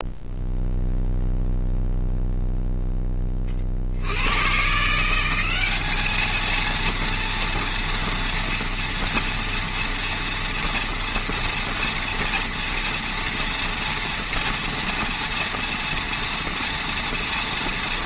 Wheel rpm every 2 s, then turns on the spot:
0, 10, 140, 230, 230, 230, 230, 240, 230.
none